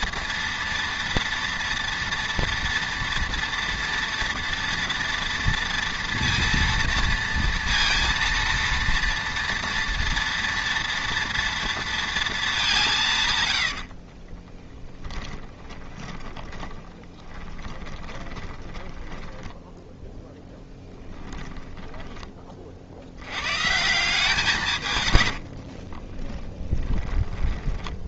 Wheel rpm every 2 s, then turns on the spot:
230, 230, 230, 230, 230, 230, 200, 20, 30, 10, 10, 40, 160, 20.
14-20 26-28